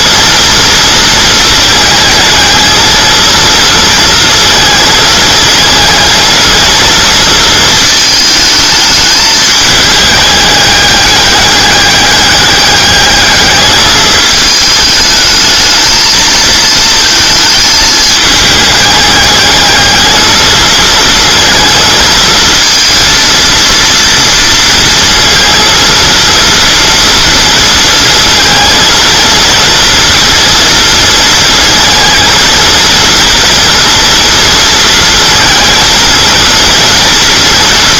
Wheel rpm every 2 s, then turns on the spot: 230, 220, 230, 230, 220, 210, 200, 210, 220, 210, 220, 230, 230, 230, 230, 230, 230, 230, 230.
none